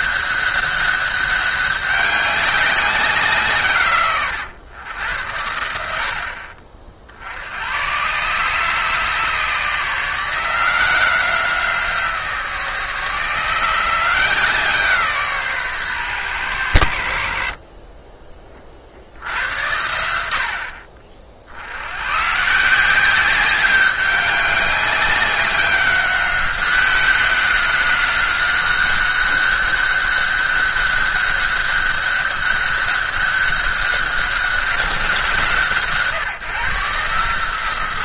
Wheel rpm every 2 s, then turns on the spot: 200, 190, 110, 50, 150, 170, 160, 160, 70, 40, 60, 160, 200, 190, 190, 200, 200, 190, 150.
none